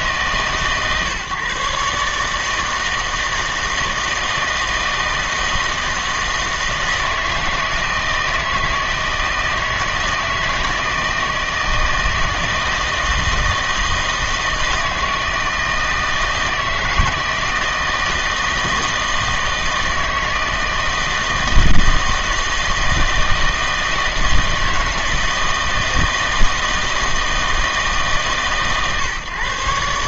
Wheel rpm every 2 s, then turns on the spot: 140, 160, 160, 160, 160, 160, 160, 160, 160, 160, 160, 160, 160, 160, 140.
none